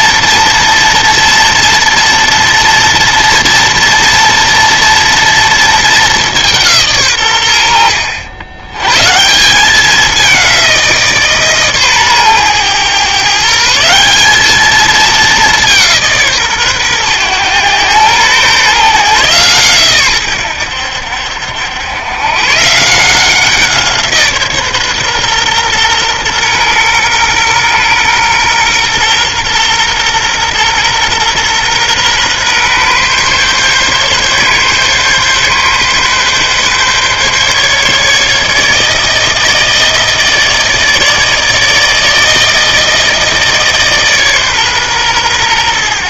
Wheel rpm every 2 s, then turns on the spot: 230, 230, 240, 180, 100, 180, 120, 210, 140, 130, 90, 150, 140, 120, 120, 120, 130, 140, 140, 150, 160, 160, 140.
none